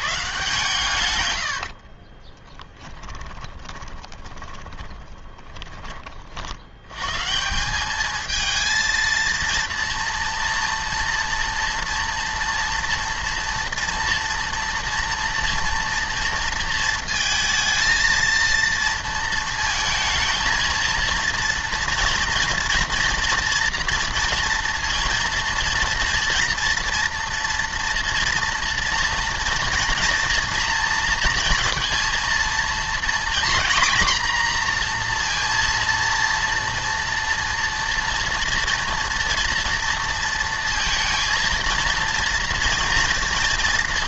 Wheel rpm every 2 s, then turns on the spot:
130, 10, 20, 80, 230, 230, 230, 230, 230, 230, 230, 230, 230, 230, 230, 230, 240, 240, 230, 240, 230, 230.
2-6